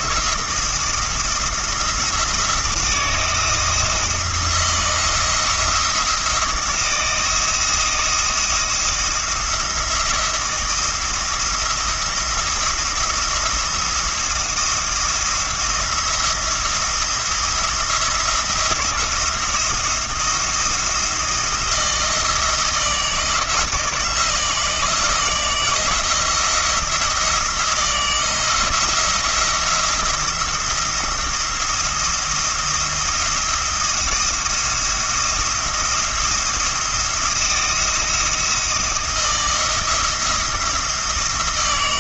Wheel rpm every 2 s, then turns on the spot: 170, 170, 170, 160, 170, 170, 170, 170, 170, 170, 170, 160, 160, 170, 160, 170, 170, 170, 170, 170, 170.
none